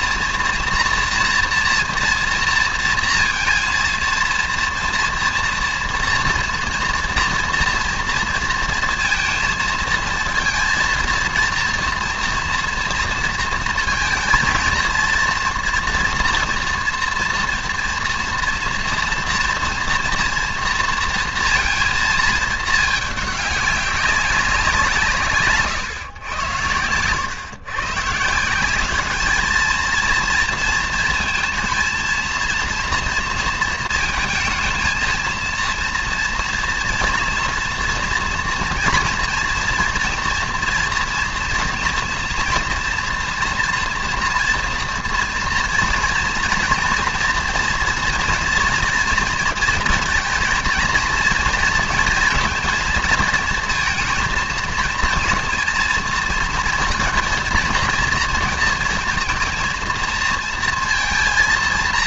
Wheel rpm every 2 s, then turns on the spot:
230, 230, 230, 230, 230, 230, 230, 230, 230, 230, 230, 210, 160, 100, 210, 230, 230, 220, 230, 230, 240, 240, 230, 240, 230, 230, 230, 230, 230, 230, 230.
none